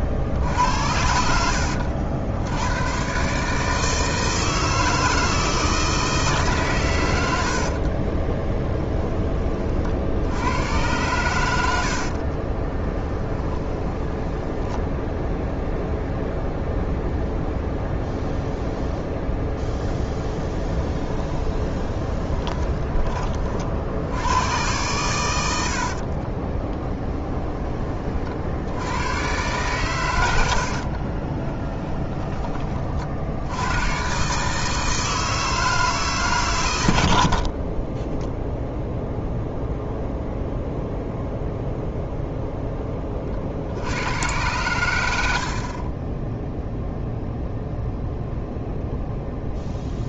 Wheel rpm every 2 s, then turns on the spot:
70, 100, 160, 120, 10, 100, 20, 10, 0, 0, 10, 20, 110, 30, 80, 60, 40, 160, 110, 0, 0, 10, 100, 0, 0.
12-16 20-22 26-28 30-32